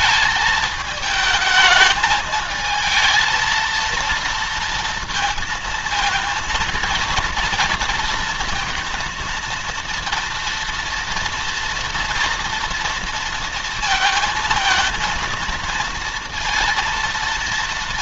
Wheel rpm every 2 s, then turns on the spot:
220, 220, 230, 230, 230, 230, 230, 230, 230.
none